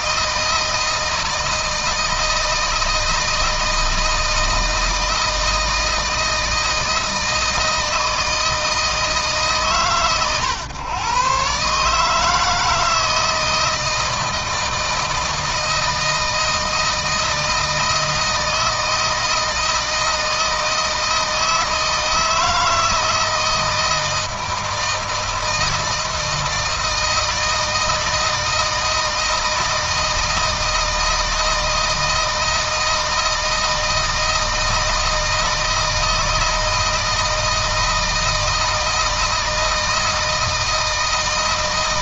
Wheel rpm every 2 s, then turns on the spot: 160, 160, 160, 160, 160, 120, 160, 160, 160, 160, 160, 160, 160, 160, 160, 160, 160, 160, 160, 160, 160.
none